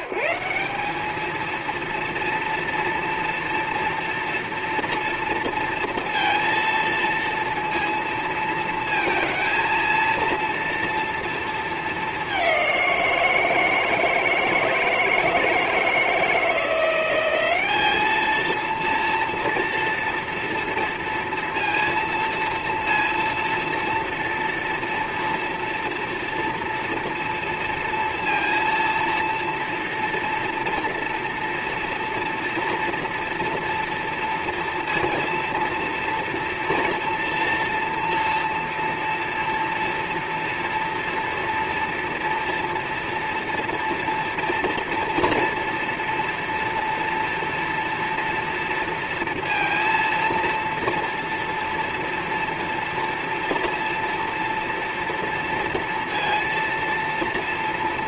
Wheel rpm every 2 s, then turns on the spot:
190, 230, 230, 230, 230, 230, 200, 160, 170, 220, 230, 230, 230, 230, 230, 230, 230, 230, 230, 230, 230, 230, 230, 230, 230, 230, 230, 230, 230.
none